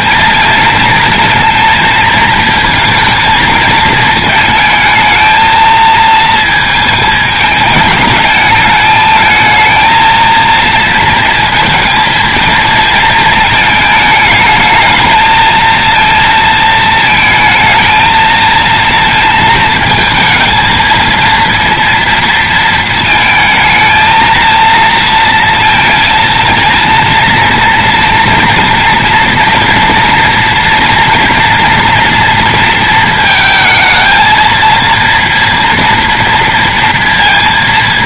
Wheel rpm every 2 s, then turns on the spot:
230, 220, 220, 220, 210, 230, 220, 220, 230, 230, 230, 230, 230, 230, 230, 230, 230, 230, 230.
none